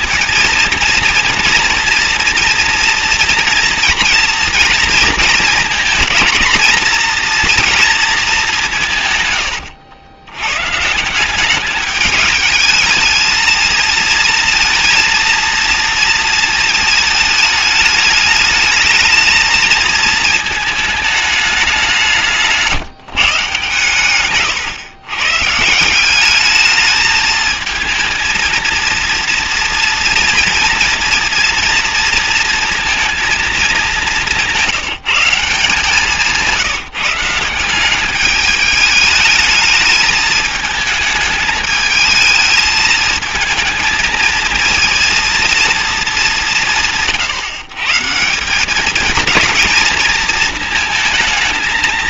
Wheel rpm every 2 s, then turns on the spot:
230, 240, 230, 230, 90, 200, 220, 230, 210, 220, 200, 140, 150, 220, 230, 230, 210, 170, 170, 210, 220, 220, 230, 140, 230, 220.
8-10